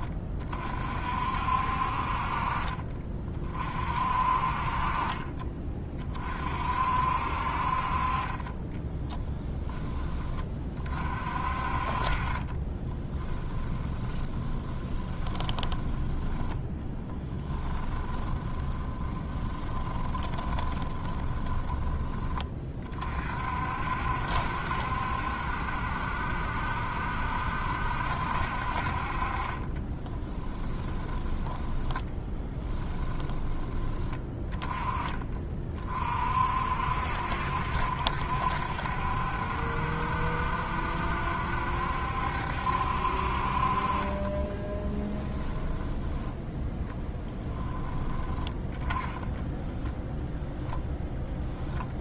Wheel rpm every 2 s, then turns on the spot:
50, 40, 40, 60, 30, 30, 20, 20, 10, 30, 20, 30, 70, 70, 50, 10, 10, 20, 60, 70, 70, 70, 20, 10, 10, 0.
8-10 12-22 30-34 44-46